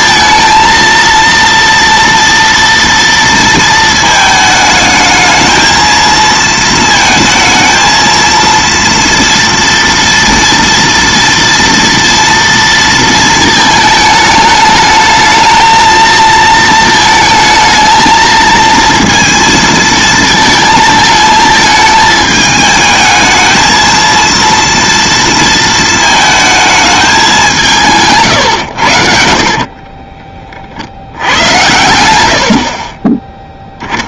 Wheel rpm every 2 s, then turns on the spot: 230, 230, 220, 220, 230, 230, 230, 210, 220, 230, 220, 220, 230, 220, 100, 50, 60.
32-34